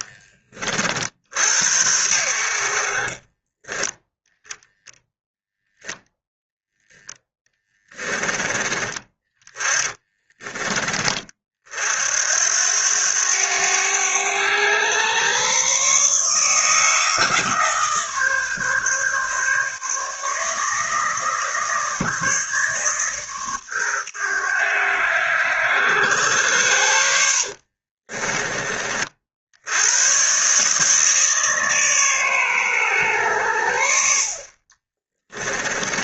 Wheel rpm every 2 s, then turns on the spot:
50, 50, 10, 10, 20, 10, 80, 110, 150, 150, 160, 150, 100, 90, 30, 140, 130, 40.
34-36